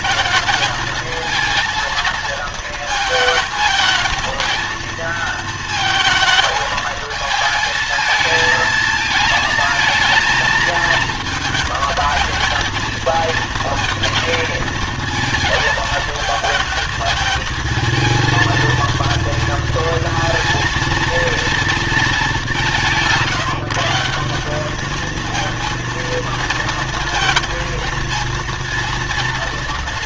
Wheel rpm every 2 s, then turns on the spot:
220, 220, 230, 220, 220, 230, 230, 230, 220, 220, 230, 170, 200, 230, 230.
none